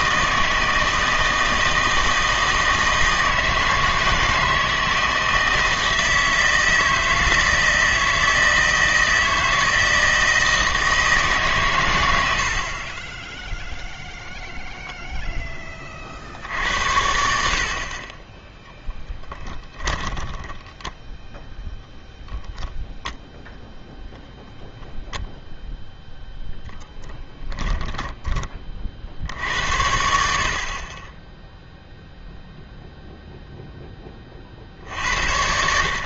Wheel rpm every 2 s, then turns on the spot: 160, 160, 160, 160, 160, 160, 60, 0, 70, 10, 10, 0, 0, 0, 30, 50, 0, 50.
20-22